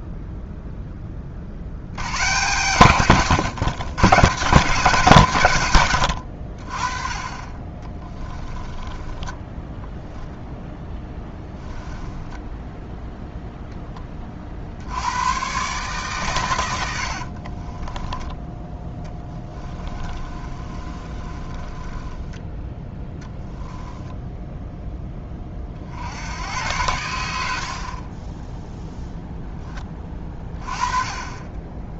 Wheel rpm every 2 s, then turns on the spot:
10, 140, 150, 30, 20, 10, 0, 70, 80, 20, 30, 10, 10, 100, 0, 20.
8-10 16-22